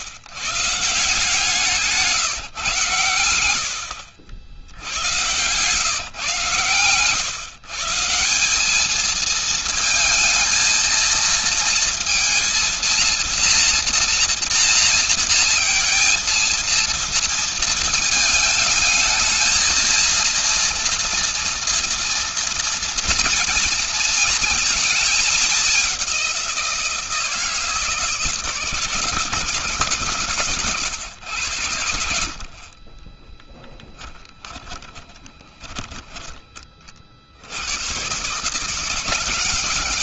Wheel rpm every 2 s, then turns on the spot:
150, 110, 90, 120, 220, 230, 230, 230, 230, 220, 230, 230, 220, 170, 160, 110, 30, 10, 40, 160.
32-36